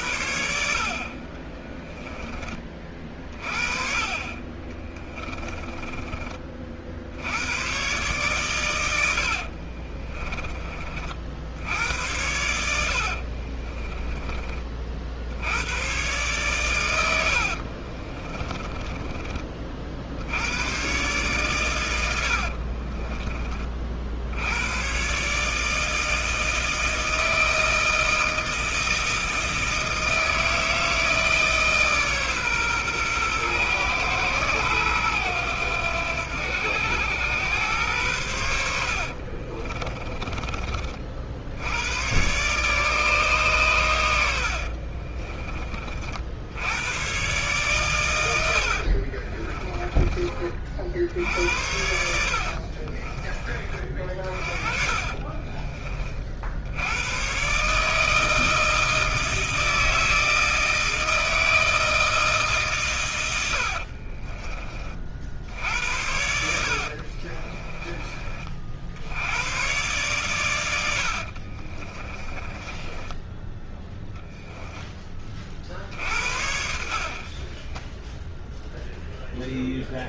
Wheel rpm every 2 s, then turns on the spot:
70, 30, 40, 40, 110, 20, 80, 30, 110, 20, 80, 60, 90, 160, 160, 160, 130, 110, 90, 80, 40, 130, 80, 90, 70, 40, 50, 40, 60, 160, 160, 150, 30, 70, 50, 110, 20, 0, 70, 10.
4-6 12-14 18-20 22-24 38-40 44-46 48-50 52-56 66-68 70-74 76-80